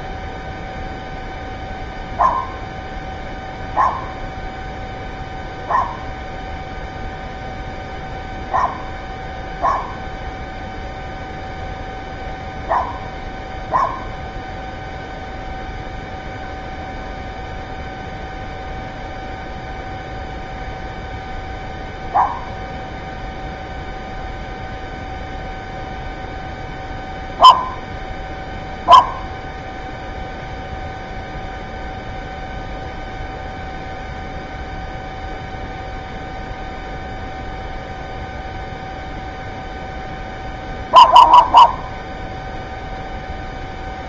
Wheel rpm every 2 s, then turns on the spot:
0, 0, 0, 0, 0, 0, 0, 0, 0, 0, 0, 0, 0, 0, 0, 0, 0, 0, 0, 0, 0, 0.
none